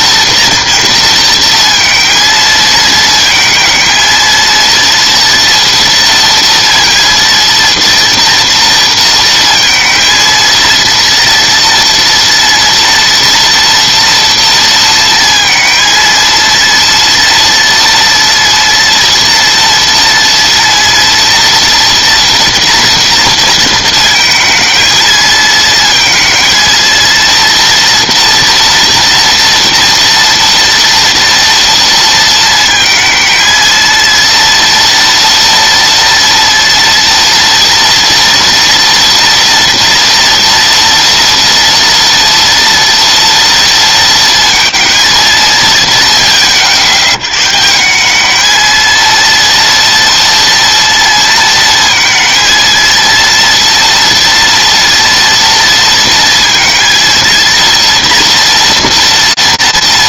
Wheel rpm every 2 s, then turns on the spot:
230, 220, 230, 230, 230, 230, 230, 230, 230, 230, 230, 230, 220, 230, 240, 230, 230, 230, 230, 230, 230, 230, 230, 110, 220, 230, 230, 230, 230, 230.
none